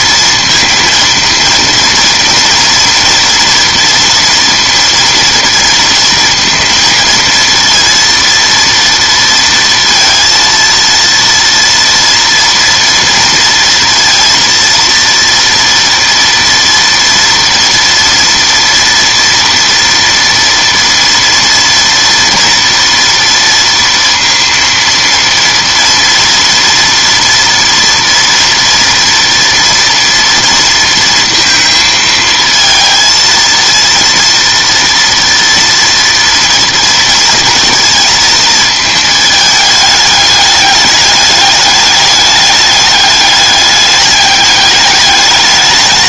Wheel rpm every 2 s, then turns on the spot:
230, 230, 230, 230, 230, 230, 230, 230, 230, 230, 230, 230, 230, 230, 230, 230, 220, 230, 230, 220, 210, 210, 210.
none